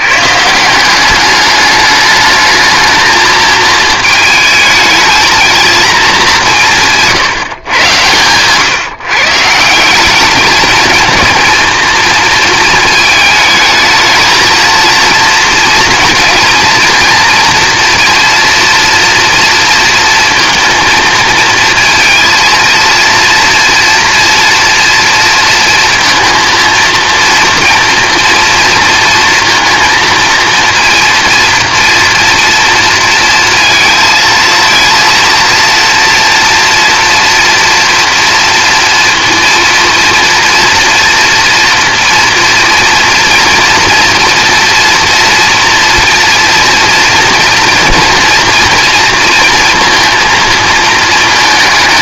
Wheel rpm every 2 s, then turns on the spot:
160, 220, 220, 170, 130, 220, 220, 230, 230, 230, 230, 230, 230, 230, 230, 230, 230, 230, 230, 230, 240, 230, 230, 230, 230, 220.
none